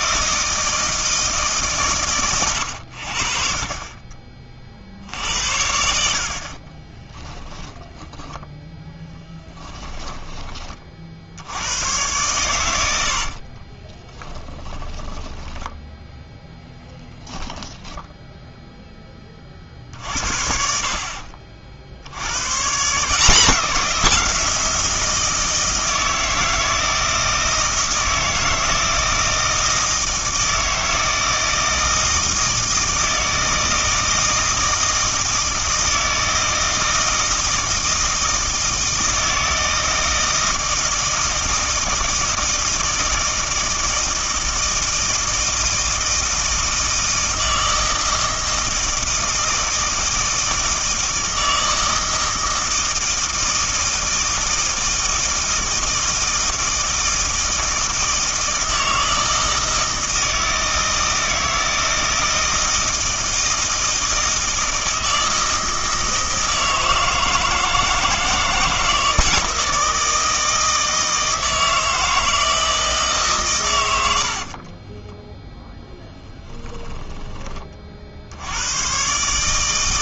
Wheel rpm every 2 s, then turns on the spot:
160, 90, 40, 40, 10, 30, 100, 20, 0, 0, 50, 140, 170, 170, 160, 160, 160, 160, 160, 160, 160, 160, 160, 160, 160, 160, 160, 160, 160, 160, 160, 160, 160, 160, 160, 160, 160, 40, 10, 100.
6-8 14-16 74-78